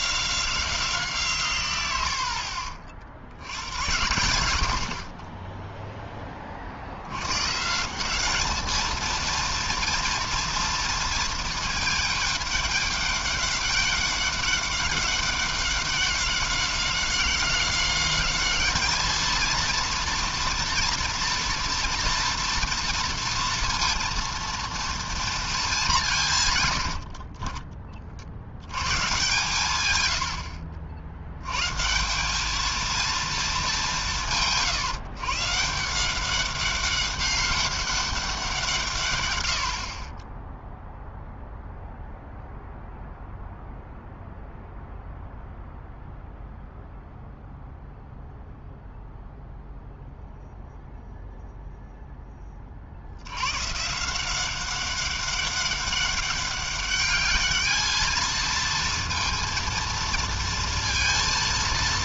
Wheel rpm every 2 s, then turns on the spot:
180, 50, 80, 40, 210, 230, 210, 200, 190, 210, 230, 230, 230, 130, 80, 80, 210, 150, 190, 180, 10, 0, 0, 0, 0, 0, 20, 190, 200, 230, 230.
2-4